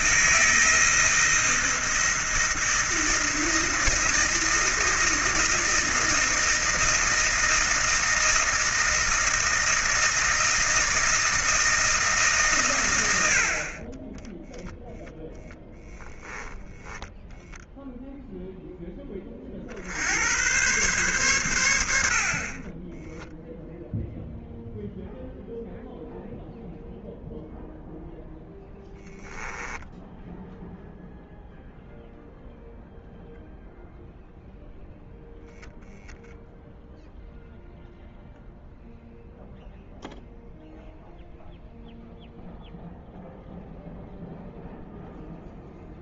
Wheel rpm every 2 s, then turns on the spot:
160, 160, 160, 160, 160, 160, 130, 10, 20, 10, 120, 20, 0, 0, 10, 0, 0, 0, 0, 0, 0, 0, 0.
16-18 22-24 28-30